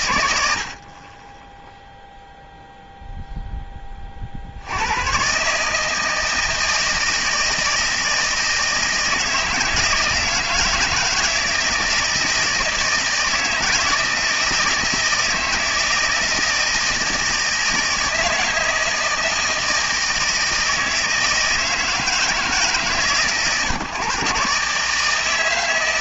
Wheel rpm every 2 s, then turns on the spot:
80, 0, 70, 160, 160, 160, 160, 160, 160, 160, 160, 150, 140.
none